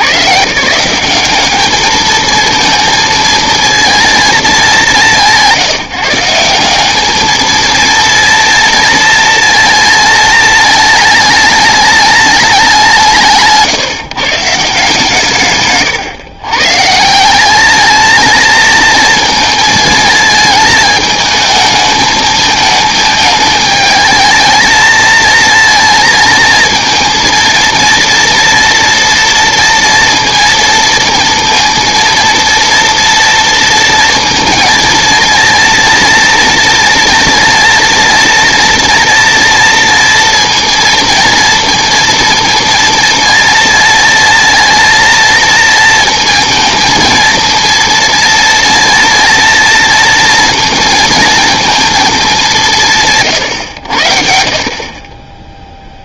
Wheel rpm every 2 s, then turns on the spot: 120, 220, 220, 170, 230, 230, 210, 160, 140, 220, 220, 220, 220, 230, 230, 230, 230, 230, 230, 230, 230, 230, 230, 230, 230, 230, 210, 70.
none